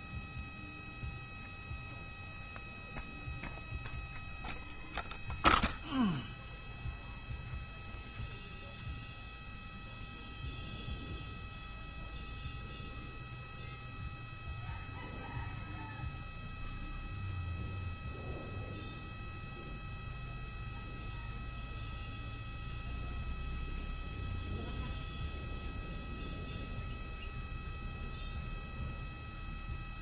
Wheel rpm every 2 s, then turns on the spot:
0, 0, 0, 0, 0, 0, 0, 0, 0, 0, 0, 0, 0, 0, 0.
none